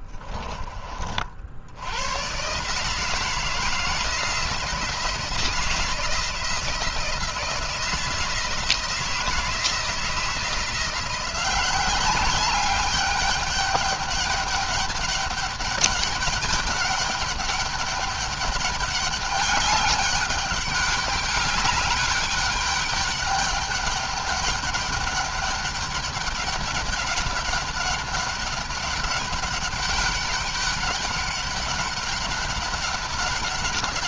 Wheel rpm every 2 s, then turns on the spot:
40, 160, 160, 160, 170, 170, 200, 200, 200, 200, 200, 200, 210, 200, 200, 200, 200.
none